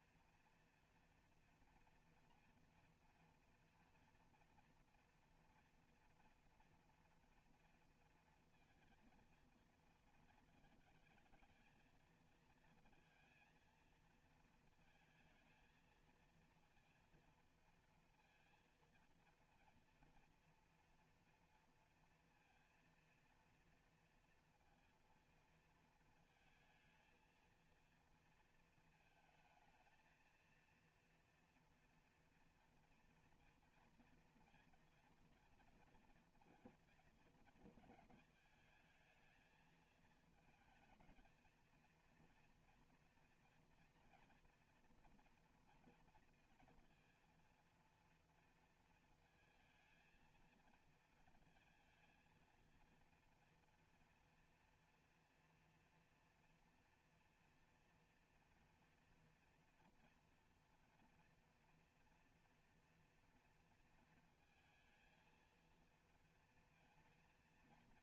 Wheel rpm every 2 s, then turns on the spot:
230, 230, 230, 230, 230, 230, 230, 230, 230, 230, 230, 230, 230, 230, 230, 230, 230, 230, 230, 220, 220, 230, 240, 230, 230, 230, 230, 230, 230, 230, 240, 230, 220, 230.
none